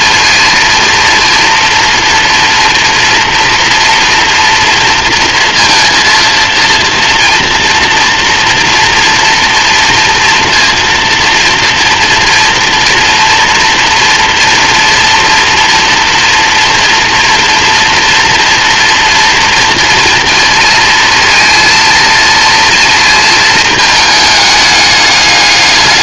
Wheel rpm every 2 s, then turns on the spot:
230, 230, 230, 230, 230, 230, 230, 230, 230, 230, 230, 230, 210.
none